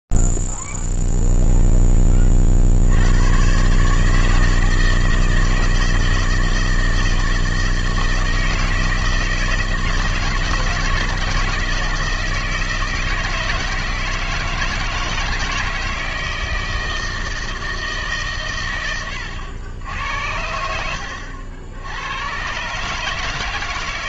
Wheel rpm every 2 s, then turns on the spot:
0, 10, 140, 160, 160, 160, 160, 160, 160, 150, 80, 110.
none